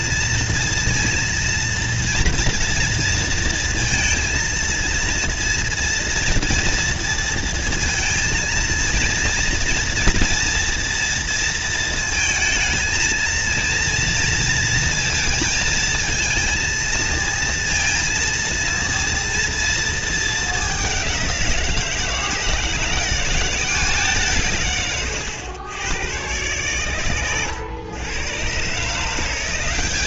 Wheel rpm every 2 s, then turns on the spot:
230, 230, 230, 230, 220, 230, 220, 230, 230, 230, 210, 170, 150, 110, 120.
none